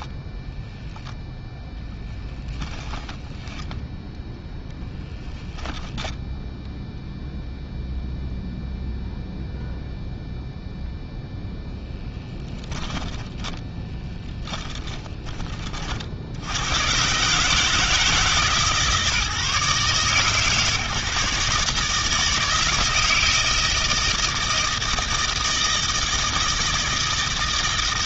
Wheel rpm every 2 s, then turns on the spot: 10, 10, 10, 0, 0, 0, 10, 10, 90, 140, 140, 160, 160, 160.
0-6 12-16